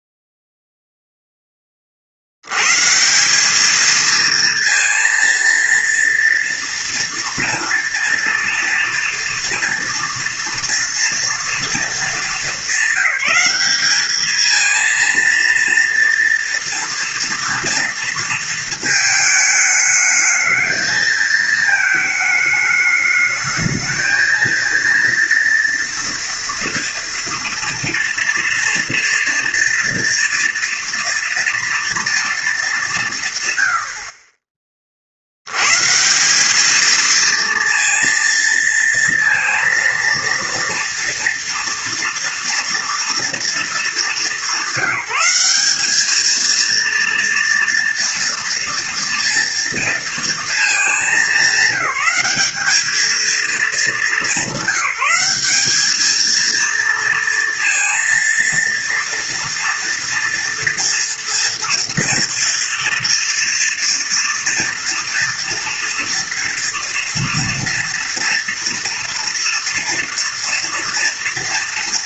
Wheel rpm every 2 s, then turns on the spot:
0, 110, 230, 230, 230, 230, 220, 220, 230, 230, 220, 210, 230, 230, 230, 230, 210, 30, 210, 230, 230, 230, 200, 230, 230, 220, 200, 190, 230, 230, 230, 230, 230, 230, 230, 230.
none